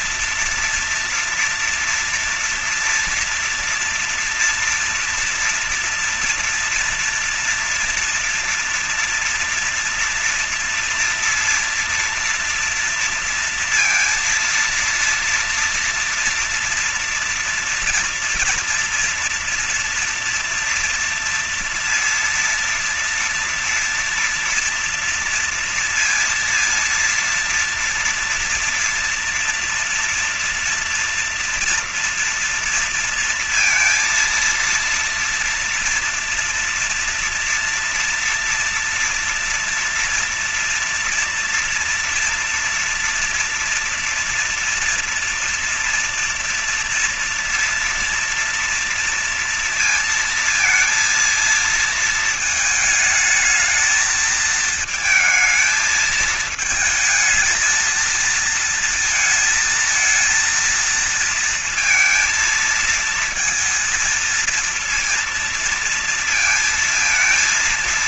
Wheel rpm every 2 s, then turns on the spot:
230, 230, 240, 230, 240, 230, 230, 230, 230, 230, 240, 230, 230, 230, 230, 240, 230, 230, 230, 230, 230, 230, 230, 230, 230, 230, 220, 220, 220, 220, 230, 230, 230, 230.
none